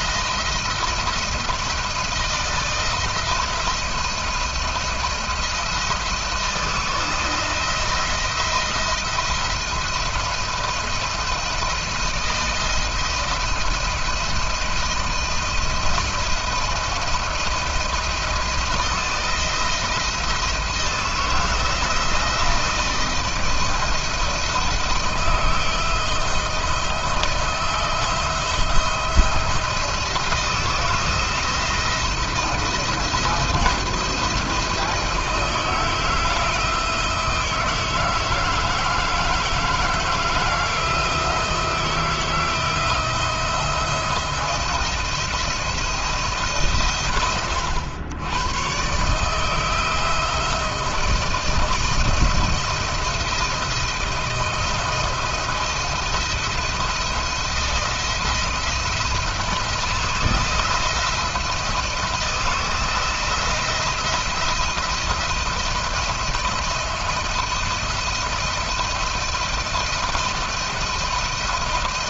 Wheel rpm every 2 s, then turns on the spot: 170, 170, 170, 160, 170, 170, 170, 160, 170, 170, 160, 160, 160, 160, 170, 170, 170, 160, 160, 160, 170, 160, 170, 140, 120, 170, 170, 160, 170, 170, 160, 160, 170, 170, 170, 170.
none